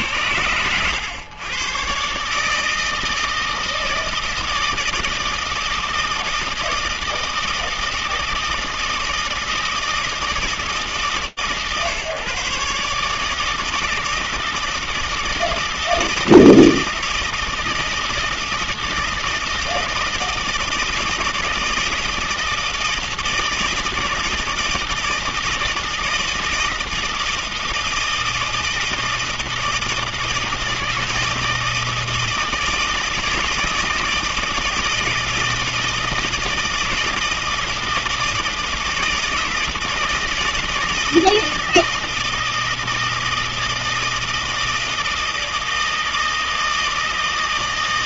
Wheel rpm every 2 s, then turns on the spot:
100, 150, 160, 160, 160, 160, 150, 160, 160, 160, 160, 160, 160, 160, 160, 160, 160, 160, 160, 160, 160, 160, 160, 160.
none